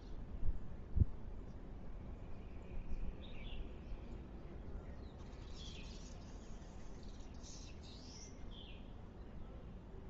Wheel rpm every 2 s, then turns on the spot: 0, 0, 0, 0, 0.
none